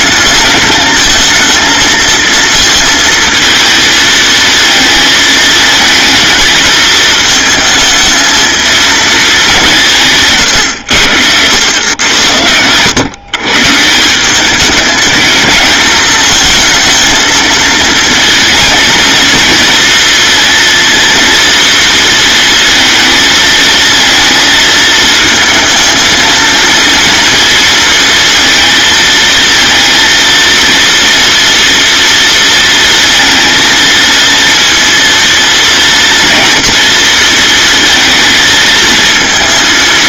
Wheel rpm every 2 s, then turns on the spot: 220, 220, 220, 220, 220, 80, 130, 210, 230, 230, 230, 220, 220, 230, 230, 230, 230, 230, 230, 230.
none